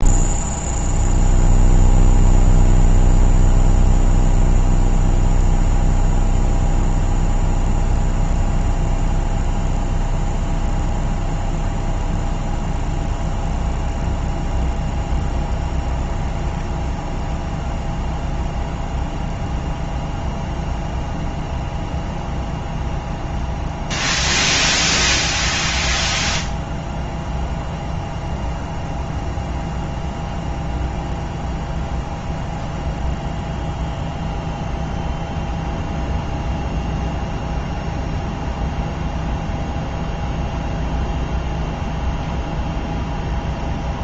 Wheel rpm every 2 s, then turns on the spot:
0, 0, 0, 0, 0, 0, 0, 0, 0, 0, 0, 10, 10, 0, 0, 0, 0, 0, 0, 0, 0, 0.
none